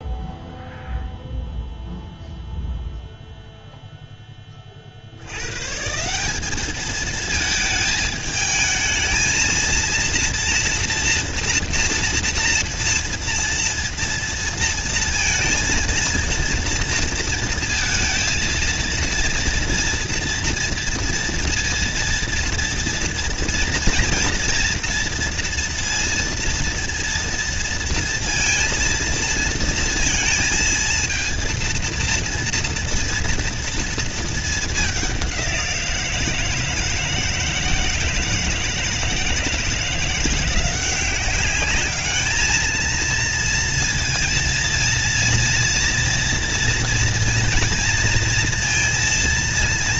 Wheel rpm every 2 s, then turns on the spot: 0, 0, 30, 200, 220, 230, 230, 230, 230, 230, 230, 240, 240, 230, 230, 230, 230, 220, 160, 160, 170, 220, 230, 230, 230.
none